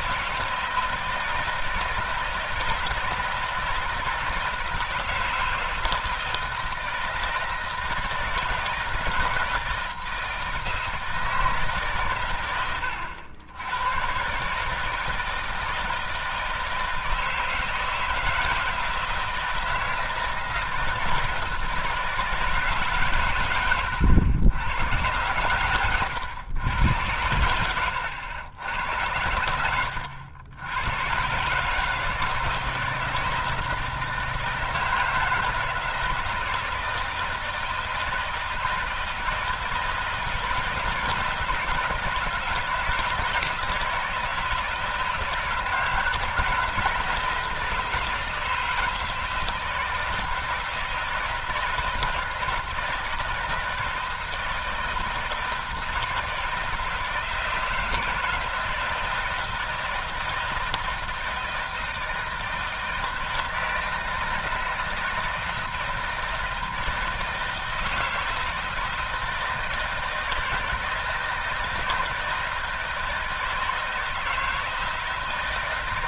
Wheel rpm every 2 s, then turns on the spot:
160, 160, 160, 160, 160, 160, 120, 120, 160, 160, 160, 160, 100, 110, 100, 90, 160, 160, 160, 160, 160, 160, 160, 160, 160, 160, 160, 160, 160, 160, 160, 160, 160, 160, 160, 160, 160, 160.
none